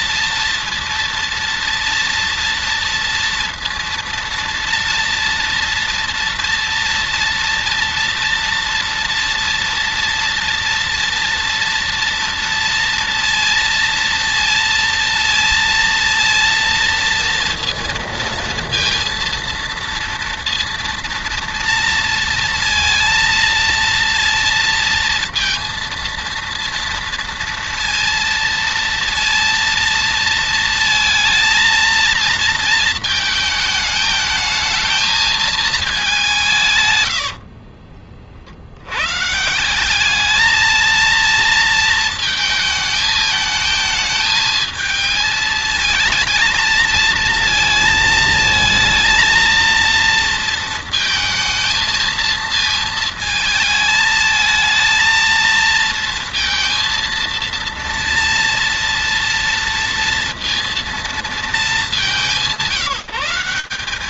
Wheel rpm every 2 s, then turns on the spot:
230, 230, 230, 230, 230, 240, 230, 230, 230, 230, 230, 230, 230, 230, 230, 230, 220, 220, 100, 140, 220, 220, 220, 230, 230, 220, 220, 230, 230, 230, 220, 190.
36-38